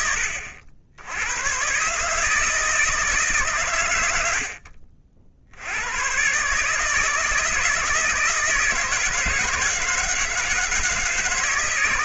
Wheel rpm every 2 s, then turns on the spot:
80, 150, 60, 150, 160, 160.
none